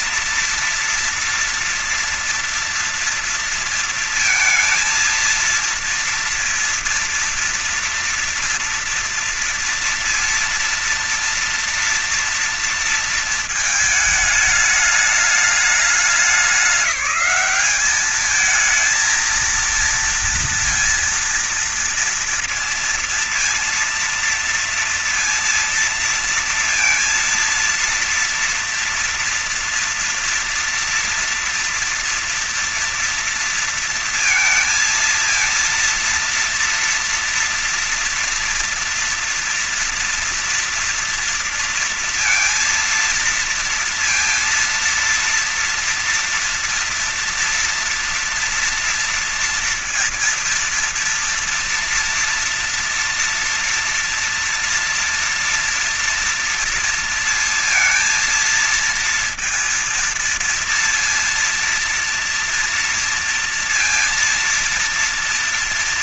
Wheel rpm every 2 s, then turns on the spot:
230, 230, 230, 230, 230, 230, 230, 220, 200, 210, 230, 230, 230, 230, 230, 230, 230, 230, 240, 230, 230, 230, 230, 230, 230, 230, 240, 230, 230, 230, 230, 230, 230.
none